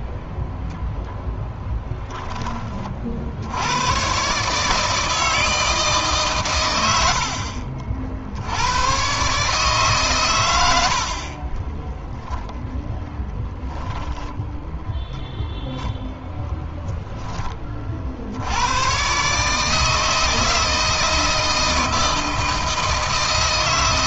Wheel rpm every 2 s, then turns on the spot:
0, 30, 150, 110, 90, 80, 0, 0, 0, 100, 160, 160.
none